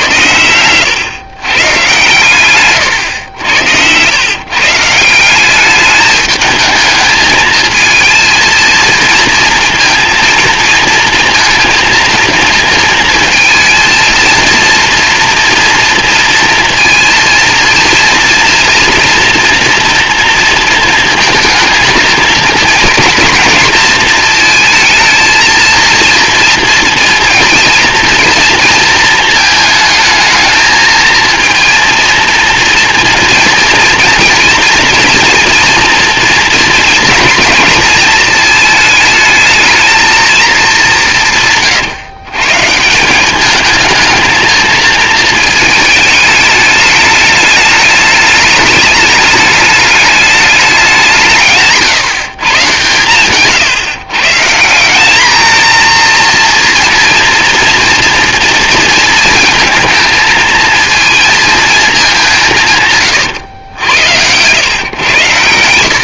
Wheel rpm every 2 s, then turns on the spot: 90, 120, 140, 220, 220, 230, 230, 230, 230, 230, 230, 230, 220, 230, 230, 220, 230, 240, 230, 220, 210, 150, 220, 210, 210, 190, 130, 160, 230, 230, 220, 160, 110.
none